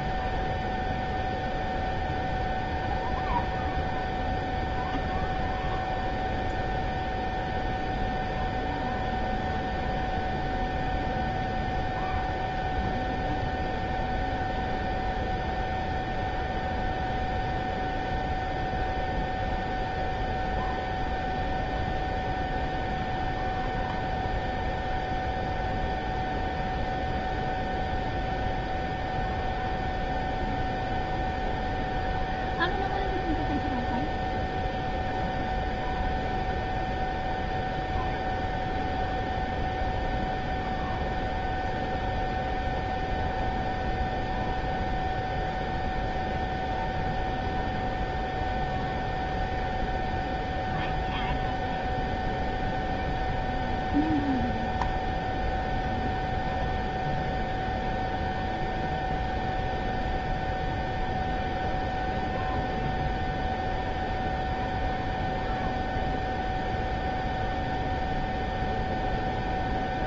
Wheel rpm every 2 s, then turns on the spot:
0, 0, 0, 0, 0, 0, 0, 0, 0, 0, 0, 0, 0, 0, 0, 0, 0, 0, 0, 0, 0, 0, 0, 0, 0, 0, 0, 0, 0, 0, 0, 0, 0, 0, 0.
none